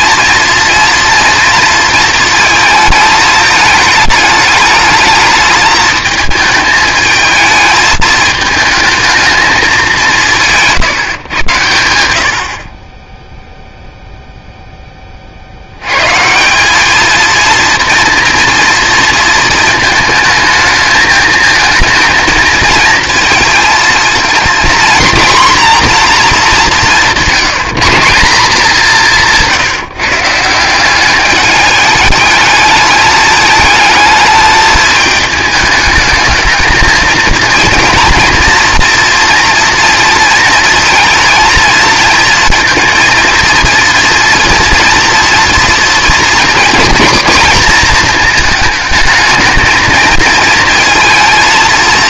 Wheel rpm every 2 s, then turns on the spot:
230, 220, 210, 220, 220, 160, 40, 0, 190, 230, 220, 220, 240, 200, 200, 170, 210, 220, 220, 230, 230, 230, 230, 230, 220, 230.
none